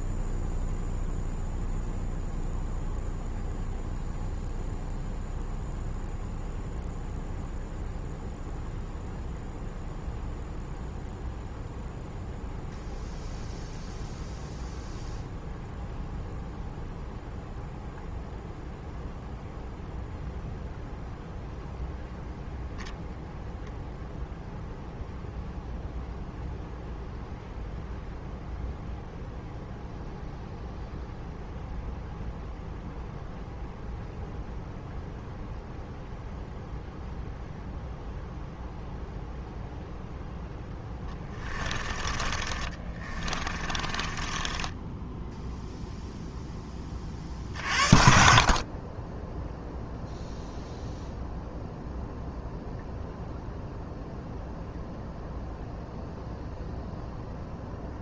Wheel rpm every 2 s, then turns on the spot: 0, 0, 0, 0, 0, 0, 0, 0, 0, 0, 0, 0, 0, 0, 0, 0, 0, 0, 0, 0, 10, 20, 20, 10, 40, 0, 0, 0, 0.
40-46